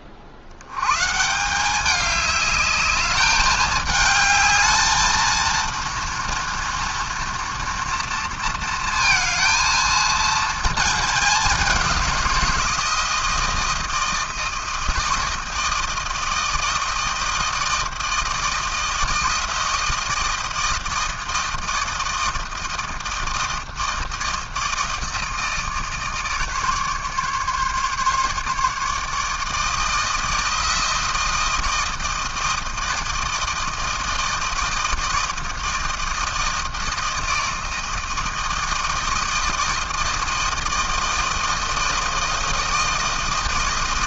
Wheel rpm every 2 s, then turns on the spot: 100, 210, 220, 230, 230, 220, 170, 160, 160, 160, 160, 160, 160, 150, 150, 160, 160, 160, 160, 160, 160, 160.
none